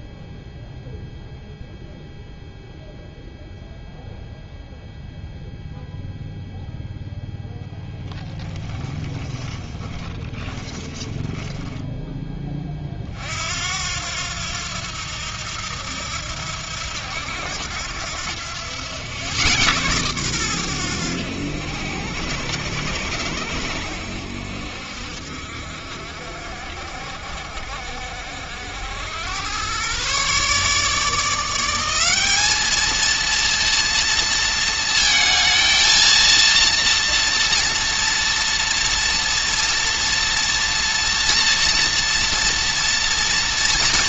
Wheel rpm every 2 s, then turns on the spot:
0, 0, 0, 0, 10, 10, 40, 80, 80, 100, 100, 90, 60, 50, 90, 150, 220, 230, 230, 230, 230, 230.
8-12